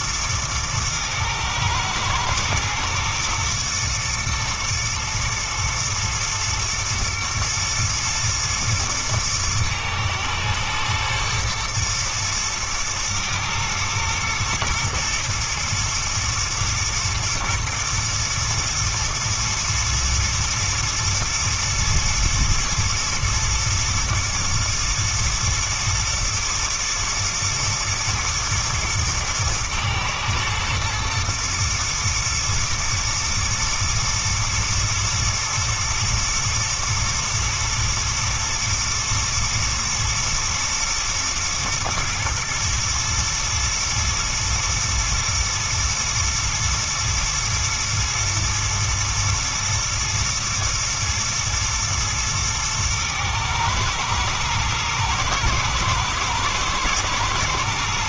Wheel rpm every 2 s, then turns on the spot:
110, 110, 110, 110, 110, 120, 110, 110, 110, 110, 120, 110, 110, 110, 120, 110, 120, 110, 120, 110, 110, 120, 120, 120, 110, 110, 110, 110, 120.
none